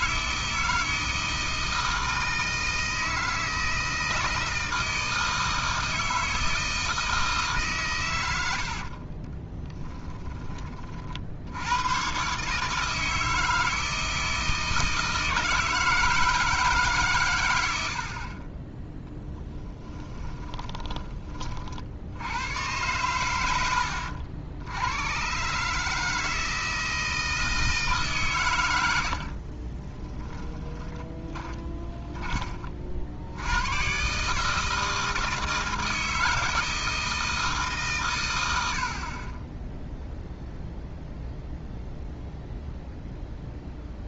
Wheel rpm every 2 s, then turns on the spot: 160, 160, 160, 160, 70, 40, 150, 160, 150, 10, 20, 100, 90, 160, 90, 10, 50, 160, 160, 60, 0, 0.
8-10 30-32